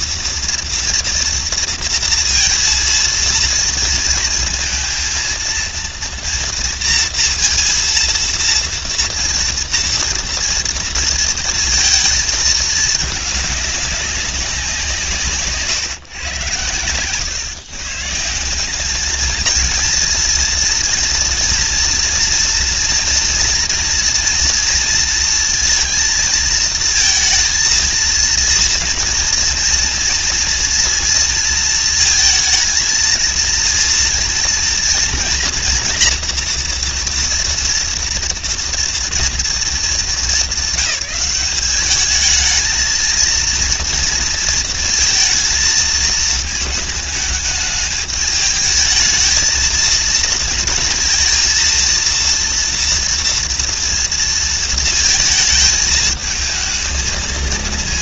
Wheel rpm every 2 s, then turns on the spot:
230, 230, 220, 230, 230, 230, 220, 180, 120, 180, 230, 230, 230, 230, 230, 230, 220, 230, 230, 230, 200, 220, 230, 220, 220, 230, 230, 230, 220.
none